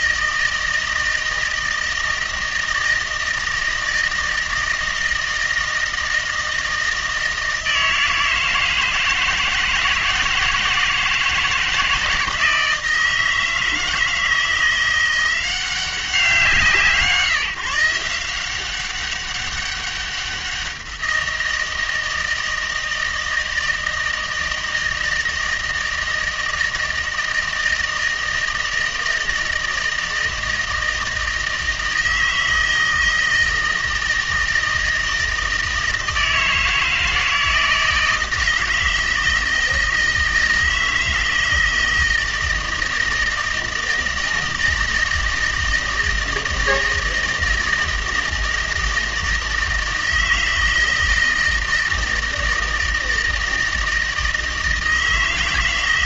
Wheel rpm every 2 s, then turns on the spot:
160, 160, 160, 160, 160, 160, 160, 170, 160, 190, 180, 160, 160, 160, 160, 160, 160, 160, 160, 160, 160, 160, 160, 160, 160, 160, 160, 160.
none